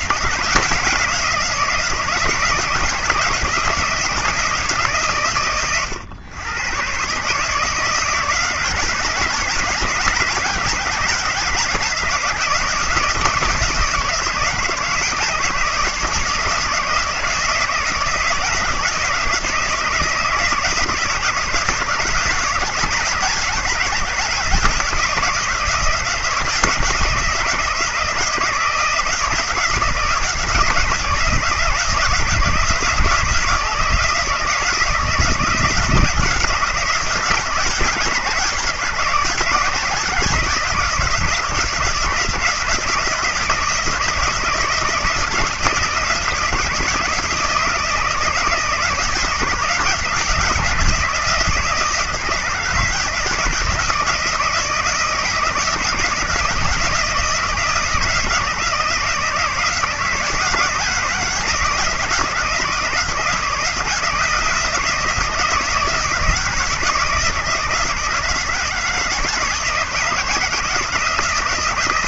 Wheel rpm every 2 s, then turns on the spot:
170, 160, 150, 130, 160, 160, 160, 160, 160, 160, 160, 170, 170, 160, 170, 160, 160, 160, 170, 160, 160, 160, 160, 160, 160, 170, 160, 160, 170, 160, 160, 160, 160, 160, 160, 170.
none